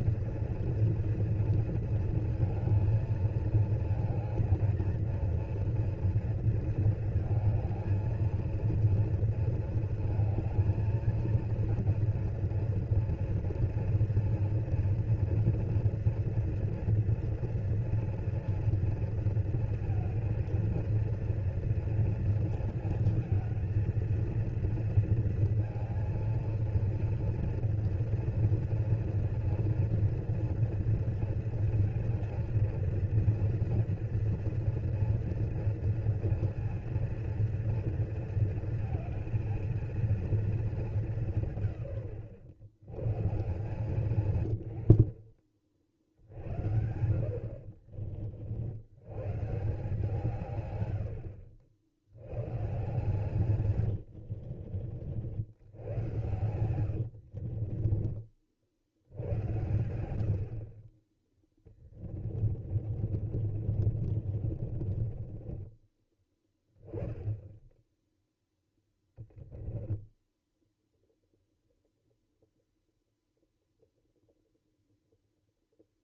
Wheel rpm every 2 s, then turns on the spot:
230, 230, 220, 230, 230, 220, 230, 230, 230, 230, 230, 230, 230, 230, 240, 230, 230, 230, 230, 230, 210, 110, 80, 70, 80, 110, 140, 60, 90, 60, 50, 40, 30, 10, 0, 0, 0, 0.
44-46 56-58 62-66